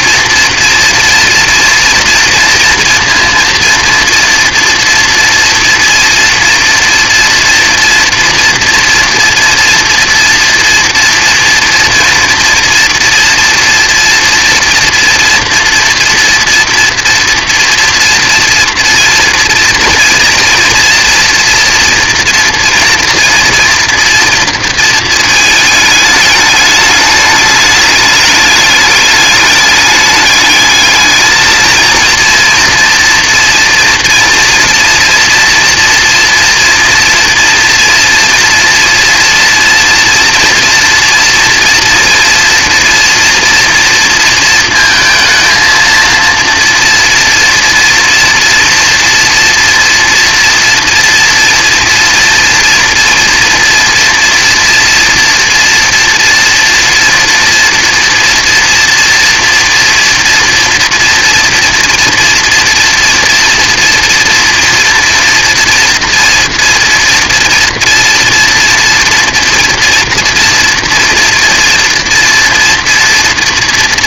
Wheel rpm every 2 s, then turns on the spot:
240, 230, 230, 230, 230, 240, 230, 230, 230, 230, 240, 240, 230, 210, 210, 210, 240, 230, 230, 230, 230, 230, 230, 230, 230, 230, 230, 230, 230, 230, 230, 230, 230, 230, 230, 240, 230.
none